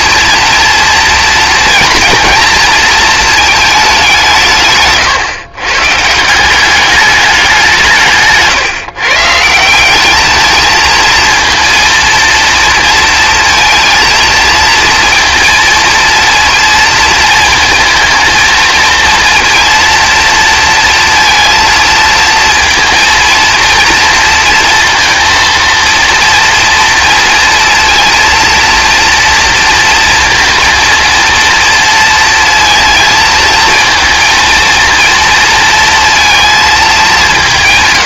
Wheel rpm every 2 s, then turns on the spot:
230, 230, 150, 200, 150, 220, 230, 230, 230, 230, 230, 230, 230, 230, 230, 230, 230, 230, 210.
none